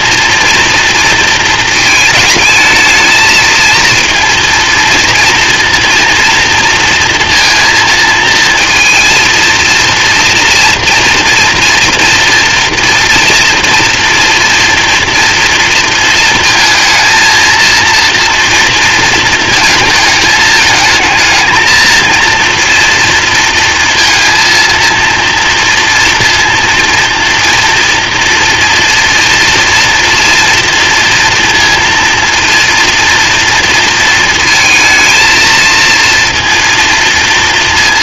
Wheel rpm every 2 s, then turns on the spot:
230, 220, 230, 230, 230, 230, 230, 230, 220, 230, 220, 230, 230, 230, 230, 230, 230, 220, 230.
none